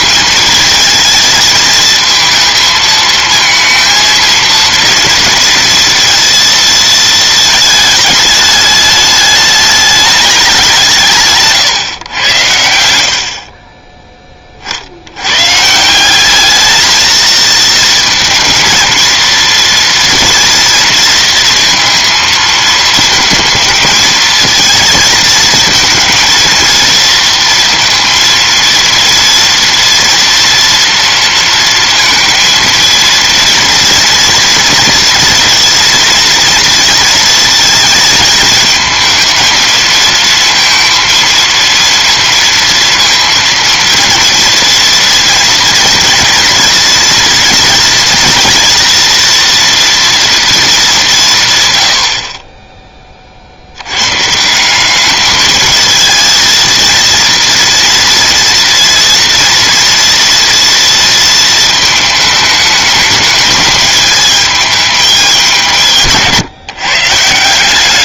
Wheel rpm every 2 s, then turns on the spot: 220, 220, 230, 230, 210, 150, 70, 80, 220, 230, 230, 220, 220, 230, 230, 230, 230, 230, 230, 220, 230, 230, 230, 230, 240, 190, 20, 200, 230, 230, 230, 210, 210, 130.
12-14